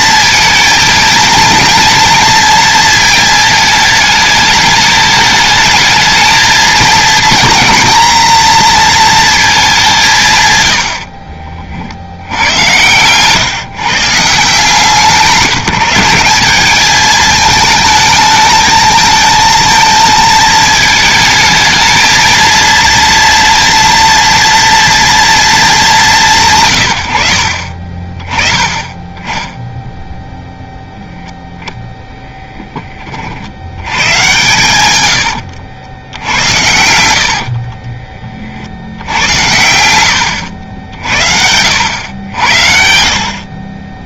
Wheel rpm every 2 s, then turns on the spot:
220, 220, 210, 230, 230, 80, 110, 170, 210, 220, 220, 230, 230, 120, 20, 0, 20, 120, 90, 80, 70, 60.
36-38